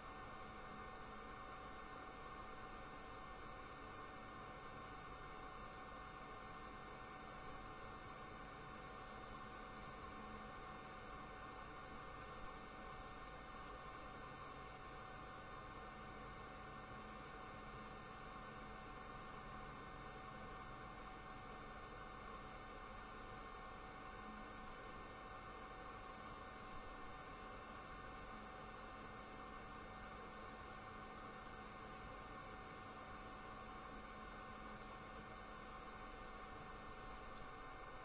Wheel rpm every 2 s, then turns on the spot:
0, 0, 0, 0, 0, 0, 0, 0, 0, 0, 0, 0, 0, 0, 0, 0, 0, 0, 0.
none